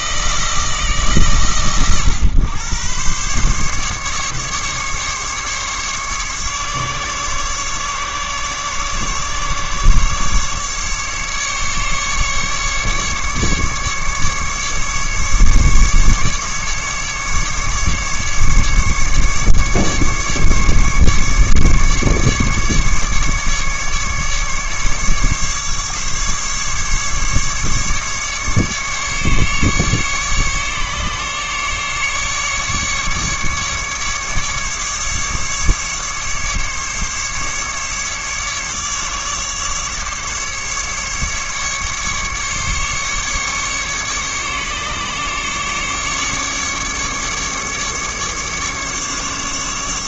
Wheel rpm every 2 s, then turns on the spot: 160, 120, 140, 140, 140, 140, 150, 140, 150, 150, 150, 140, 150, 150, 140, 140, 150, 150, 150, 140, 140, 140, 140, 140, 150.
none